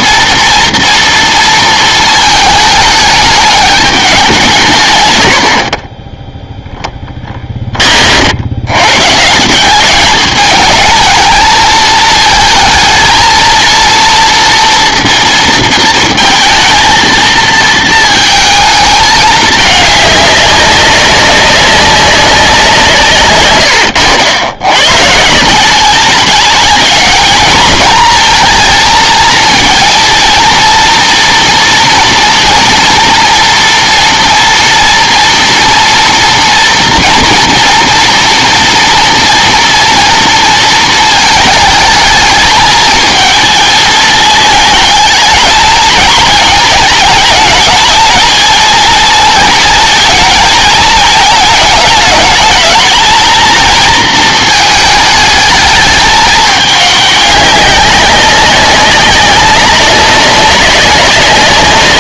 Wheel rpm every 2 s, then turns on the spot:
230, 210, 150, 0, 100, 220, 220, 230, 230, 220, 200, 180, 100, 210, 230, 240, 230, 230, 240, 230, 230, 220, 220, 220, 230, 220, 210, 220, 200, 190, 190.
none